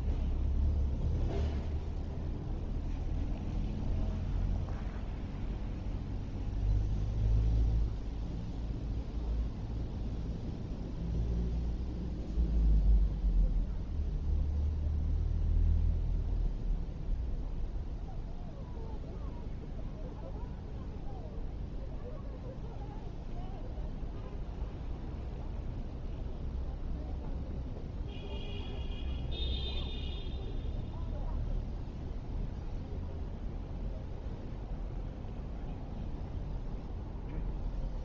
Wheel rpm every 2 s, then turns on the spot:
0, 0, 0, 0, 0, 0, 0, 0, 0, 0, 0, 0, 0, 0, 0, 0, 0, 0, 0.
none